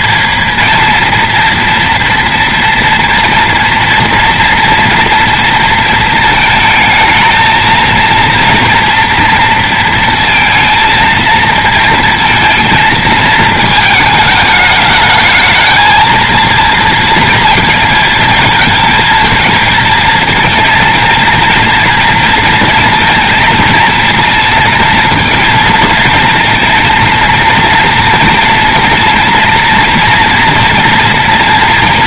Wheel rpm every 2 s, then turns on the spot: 230, 230, 230, 220, 230, 230, 220, 210, 230, 220, 230, 230, 230, 230, 230, 230.
none